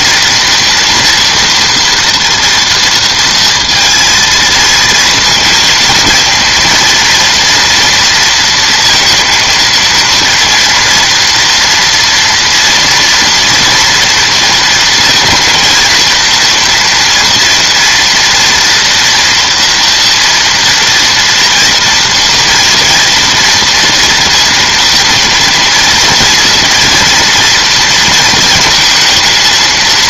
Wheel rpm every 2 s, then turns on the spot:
240, 230, 230, 230, 230, 240, 230, 230, 230, 230, 230, 230, 230, 230, 220.
none